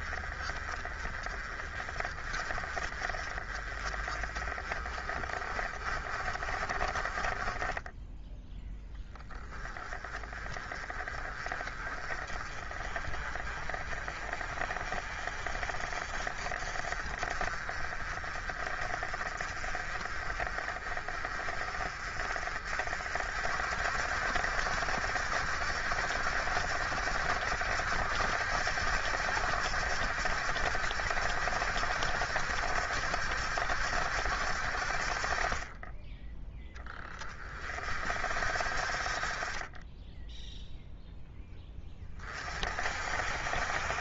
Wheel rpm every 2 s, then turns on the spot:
30, 40, 30, 30, 10, 30, 30, 40, 40, 40, 40, 50, 70, 70, 70, 70, 70, 50, 10, 50, 0, 50.
none